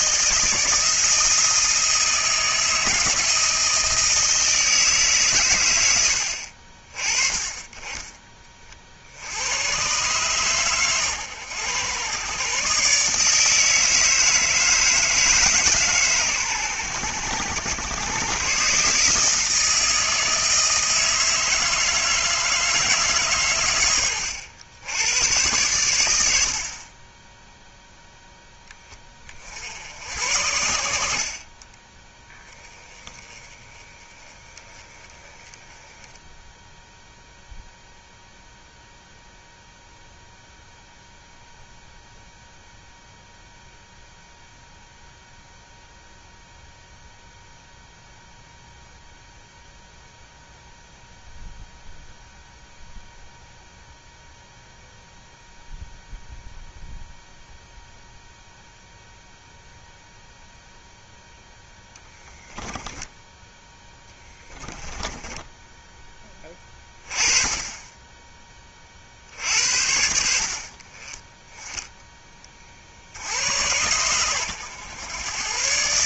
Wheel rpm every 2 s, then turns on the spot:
160, 160, 160, 60, 30, 130, 130, 160, 110, 130, 160, 160, 100, 70, 10, 80, 10, 20, 0, 0, 0, 0, 0, 0, 0, 0, 0, 0, 0, 0, 0, 10, 10, 20, 20, 60, 40, 100.
62-66